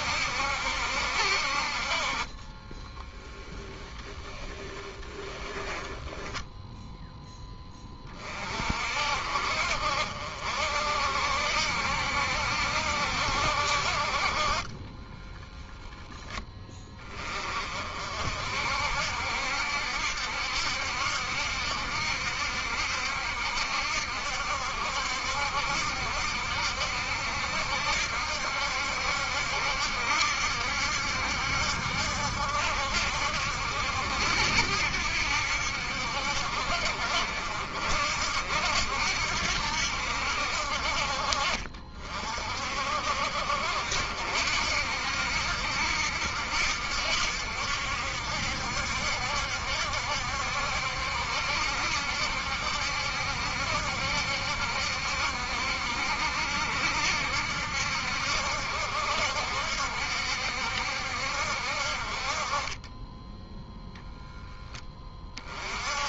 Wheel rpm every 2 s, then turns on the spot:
70, 10, 20, 10, 40, 60, 70, 40, 10, 60, 70, 70, 70, 70, 70, 70, 70, 70, 60, 70, 70, 50, 60, 70, 70, 70, 70, 70, 70, 70, 70, 30, 10.
2-6 14-16